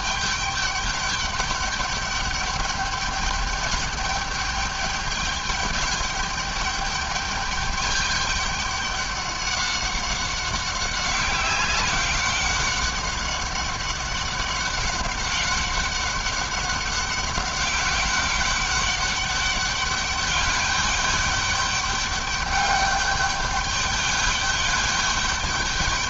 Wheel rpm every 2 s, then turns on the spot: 200, 210, 210, 210, 200, 190, 190, 190, 190, 200, 200, 200, 200.
none